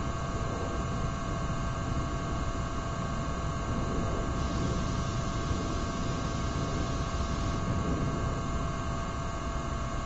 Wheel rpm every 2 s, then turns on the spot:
0, 0, 0, 0, 0.
none